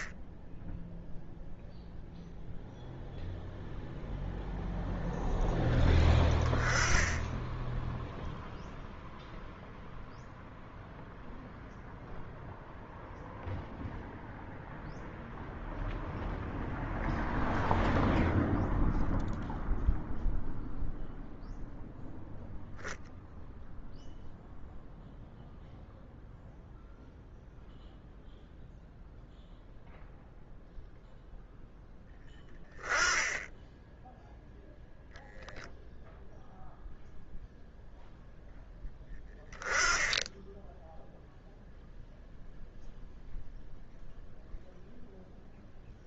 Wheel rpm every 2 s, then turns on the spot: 10, 0, 0, 20, 0, 0, 0, 0, 0, 0, 0, 0, 0, 0, 0, 0, 10, 0, 0, 0, 10, 0, 0.
none